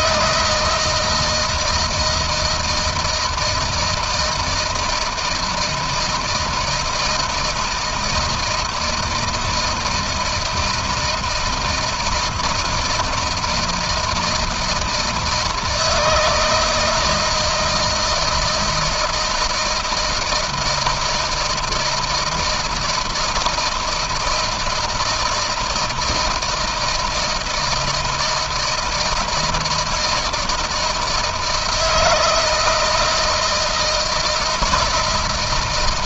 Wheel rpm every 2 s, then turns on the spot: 160, 170, 160, 160, 160, 160, 160, 160, 160, 160, 160, 160, 160, 160, 160, 160, 160, 160.
none